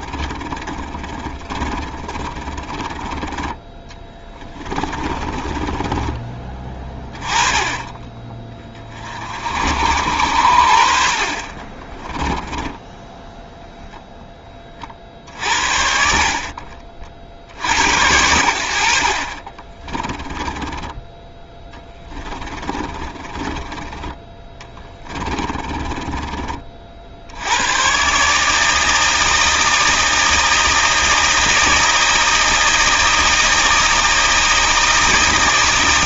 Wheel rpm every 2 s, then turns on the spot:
30, 20, 20, 20, 30, 70, 10, 30, 50, 70, 10, 30, 20, 40, 150, 160, 160, 160.
0-6 12-14 20-26